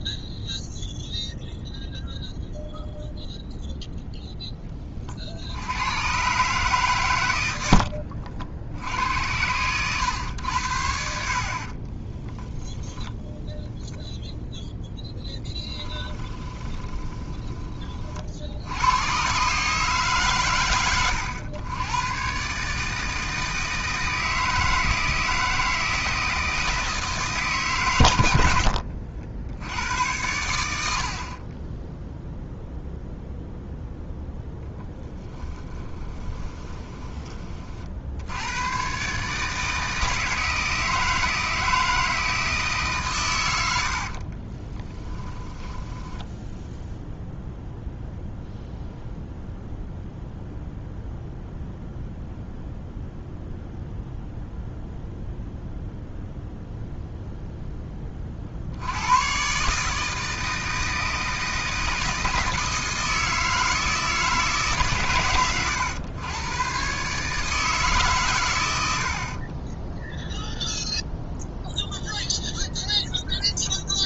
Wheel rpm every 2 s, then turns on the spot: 0, 0, 20, 130, 70, 80, 0, 0, 20, 90, 110, 150, 160, 160, 70, 70, 0, 10, 20, 120, 160, 140, 10, 0, 0, 0, 0, 0, 0, 80, 160, 160, 140, 130, 80, 0, 0.
16-18 28-30 34-38 44-46